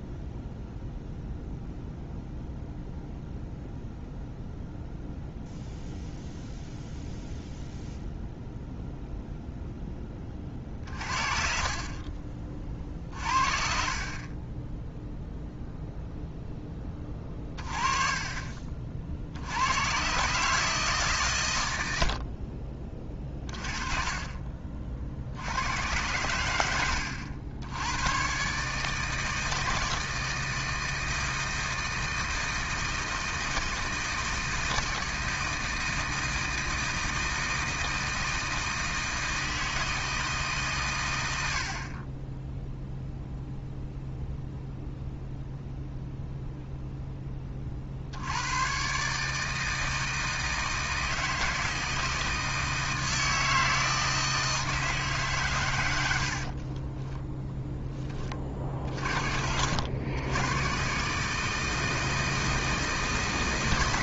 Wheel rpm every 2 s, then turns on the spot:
0, 0, 0, 0, 0, 40, 40, 10, 10, 40, 150, 40, 40, 90, 140, 160, 160, 160, 160, 160, 140, 0, 0, 0, 120, 160, 160, 160, 30, 40, 110, 160.
56-58